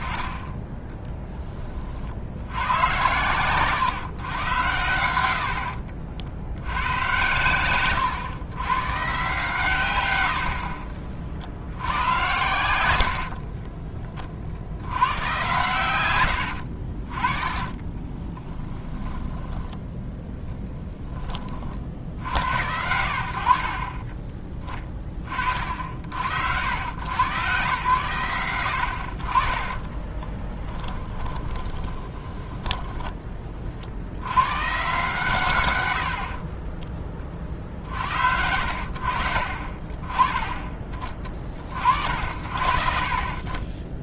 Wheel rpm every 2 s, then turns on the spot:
20, 100, 100, 90, 120, 50, 90, 80, 60, 10, 10, 80, 20, 90, 70, 10, 10, 140, 30, 70, 20, 60.
12-14 16-18 30-34 36-38